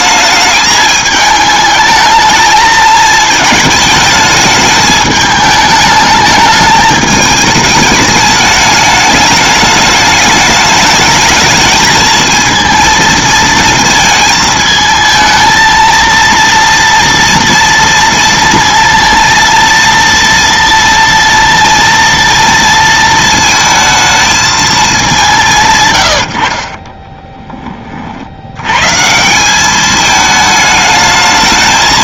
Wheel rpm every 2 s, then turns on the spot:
210, 220, 220, 210, 210, 220, 230, 220, 230, 230, 230, 230, 220, 40, 100, 210.
26-28